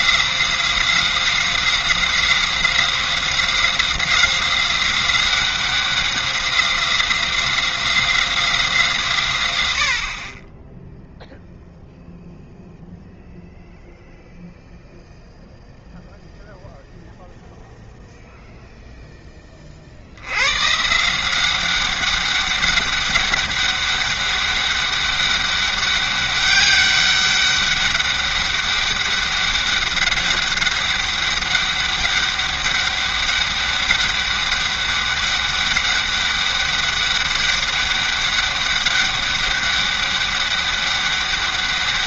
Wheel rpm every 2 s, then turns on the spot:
180, 190, 190, 190, 170, 10, 0, 0, 0, 0, 130, 200, 200, 200, 200, 200, 200, 200, 200, 200, 200.
none